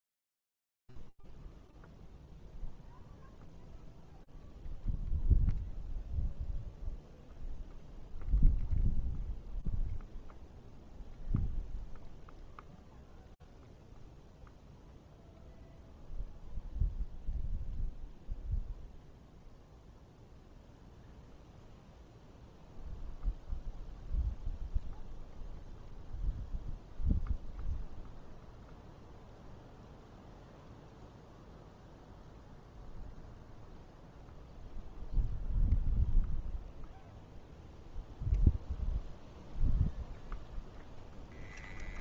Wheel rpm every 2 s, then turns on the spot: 0, 0, 0, 0, 0, 0, 0, 0, 0, 0, 0, 0, 0, 0, 0, 0, 0, 0, 0, 0, 10.
none